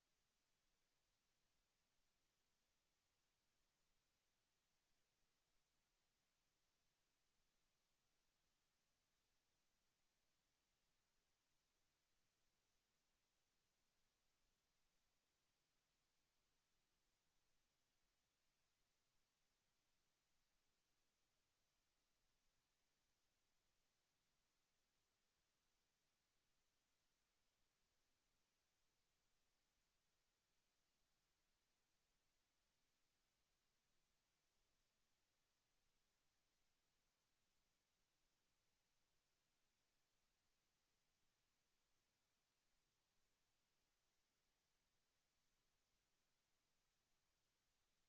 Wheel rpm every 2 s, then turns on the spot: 0, 0, 0, 0, 0, 0, 0, 0, 0, 0, 0, 0, 0, 0, 0, 0, 0, 0, 0, 0, 0, 0, 0, 0.
none